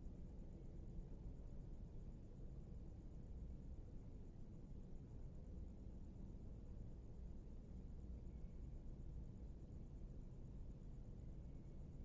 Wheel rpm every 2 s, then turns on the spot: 0, 0, 0, 0, 0, 0.
none